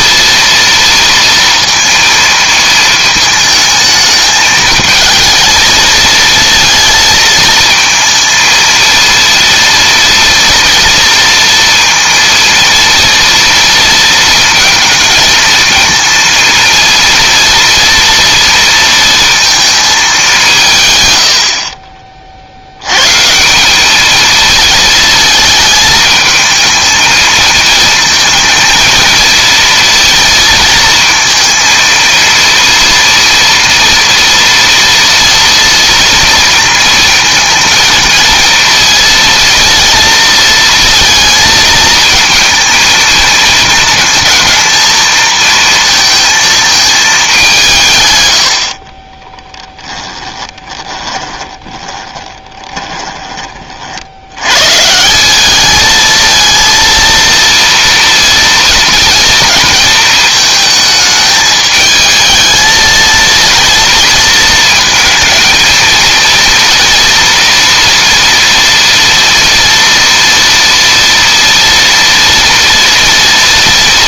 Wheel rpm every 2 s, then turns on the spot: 230, 220, 220, 230, 230, 230, 230, 230, 230, 230, 160, 90, 220, 220, 220, 230, 230, 230, 230, 230, 230, 230, 230, 220, 60, 20, 20, 130, 220, 230, 220, 220, 220, 230, 230, 230, 230.
50-54